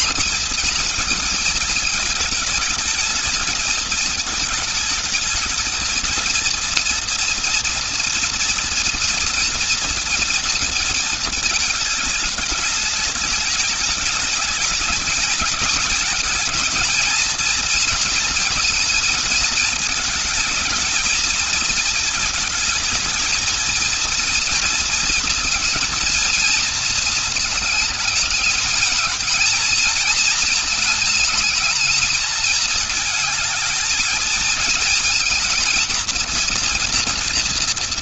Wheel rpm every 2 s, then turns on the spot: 240, 220, 220, 220, 230, 230, 210, 210, 220, 230, 220, 220, 230, 230, 220, 220, 220, 220, 230.
none